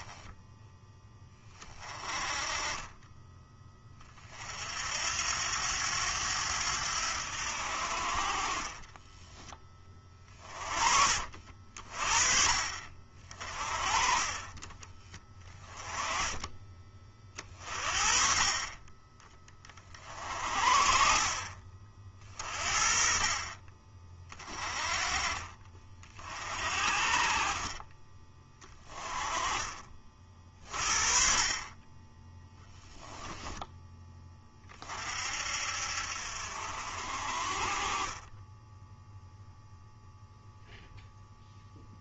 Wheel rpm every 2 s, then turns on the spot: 10, 20, 70, 90, 20, 40, 50, 40, 30, 30, 50, 40, 30, 40, 30, 40, 10, 40, 60, 10, 0.
8-10 28-30 32-34